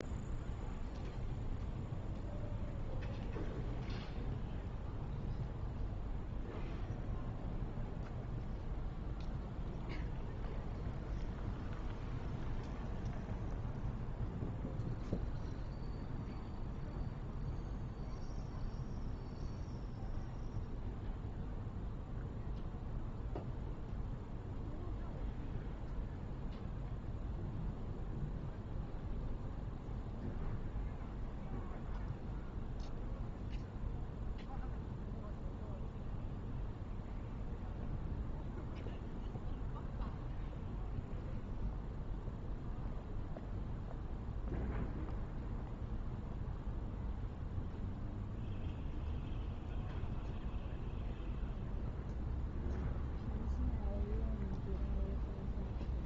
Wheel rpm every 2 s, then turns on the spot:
0, 0, 0, 0, 0, 0, 0, 0, 0, 0, 0, 0, 0, 0, 0, 0, 0, 0, 0, 0, 0, 0, 0, 0, 0, 0, 0, 0.
none